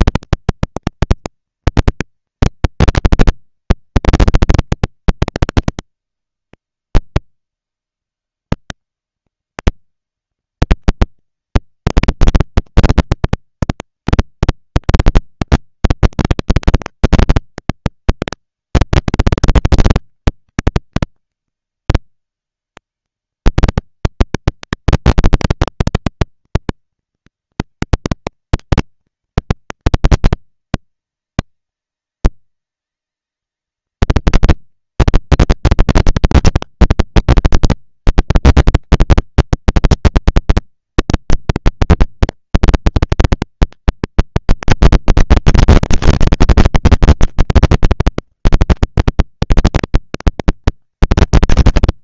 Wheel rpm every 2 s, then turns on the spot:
230, 230, 240, 110, 130, 170, 190, 200, 200, 200, 200, 200, 210, 230, 220, 230, 230, 230, 220, 230, 220, 230, 230, 220, 200, 220.
none